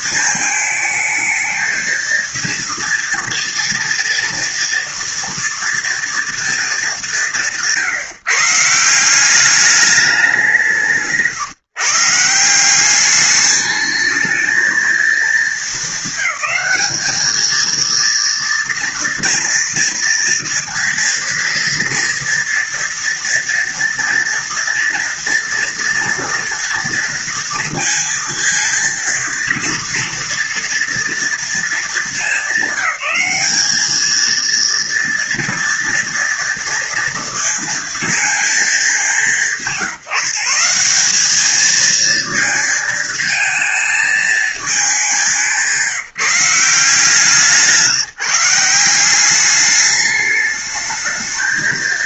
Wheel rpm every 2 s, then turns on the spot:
220, 230, 230, 230, 150, 190, 160, 220, 200, 230, 230, 230, 230, 230, 230, 230, 200, 220, 230, 220, 170, 220, 220, 170, 170, 210.
none